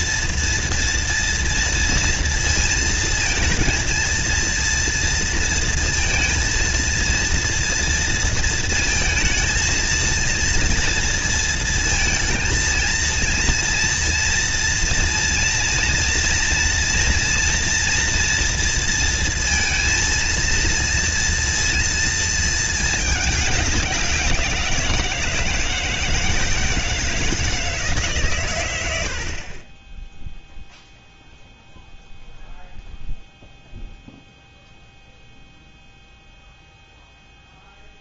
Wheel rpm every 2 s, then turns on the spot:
230, 230, 230, 230, 230, 230, 230, 230, 230, 230, 230, 220, 170, 160, 120, 0, 0, 0, 0.
none